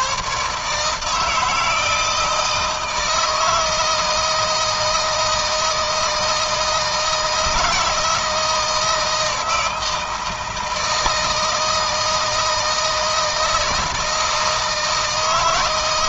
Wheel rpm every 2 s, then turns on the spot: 150, 160, 160, 160, 170, 160, 160, 160.
none